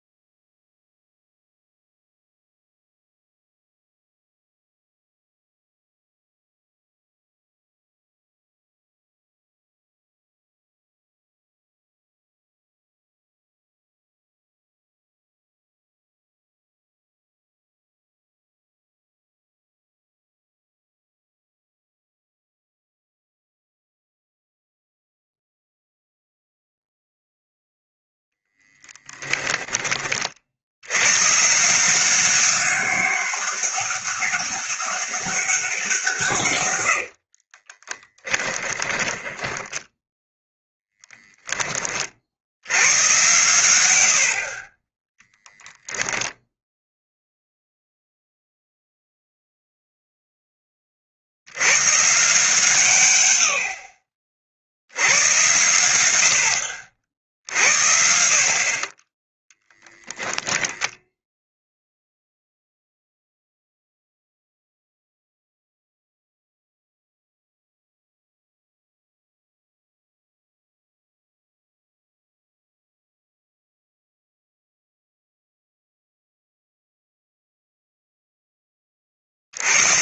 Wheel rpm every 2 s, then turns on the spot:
0, 0, 0, 0, 0, 0, 0, 0, 0, 0, 0, 0, 0, 0, 10, 90, 200, 200, 100, 10, 0, 100, 30, 0, 0, 20, 130, 80, 70, 30, 0, 0, 0, 0, 0, 0, 0, 0, 0, 30.
28-30 36-40